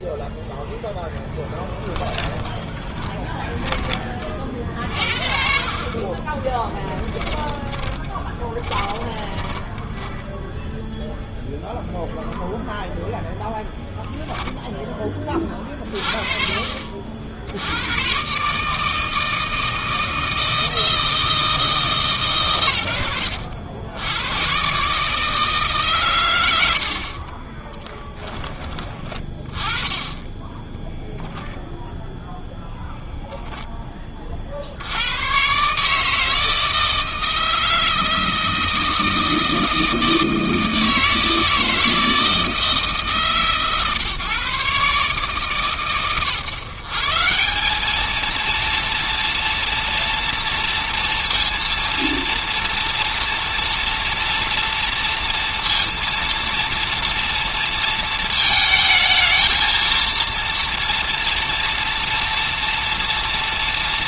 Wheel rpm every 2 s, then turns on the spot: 0, 10, 50, 10, 20, 0, 0, 10, 50, 160, 160, 110, 140, 80, 20, 0, 0, 80, 160, 160, 160, 150, 140, 140, 230, 230, 230, 230, 230, 220, 230, 230.
2-4 6-10